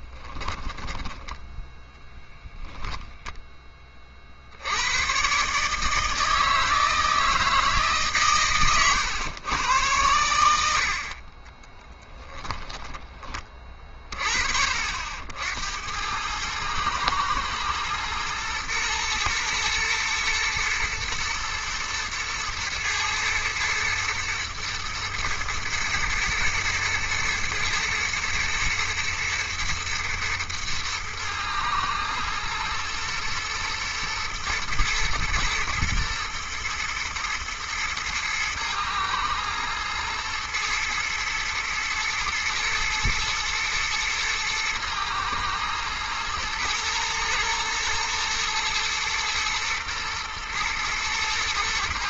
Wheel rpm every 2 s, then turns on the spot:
10, 0, 70, 160, 130, 80, 10, 40, 110, 120, 120, 120, 120, 120, 120, 120, 110, 110, 110, 110, 110, 120, 120, 110, 120, 120.
none